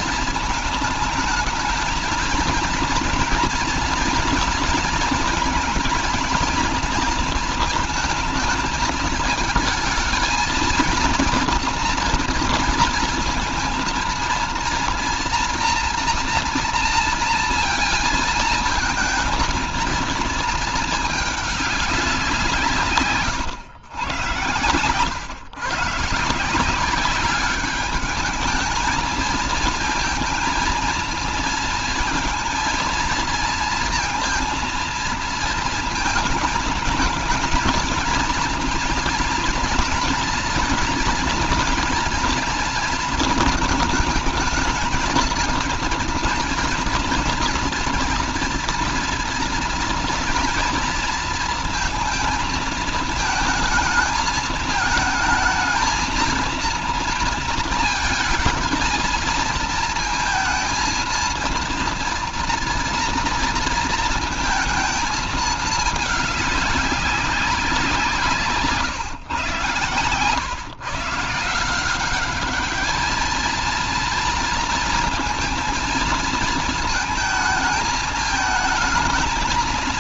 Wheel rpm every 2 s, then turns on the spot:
220, 230, 230, 230, 220, 230, 230, 230, 230, 220, 230, 170, 110, 170, 220, 230, 230, 230, 230, 230, 230, 230, 220, 240, 240, 240, 220, 220, 230, 230, 230, 230, 220, 200, 150, 130, 210, 230, 220, 220.
none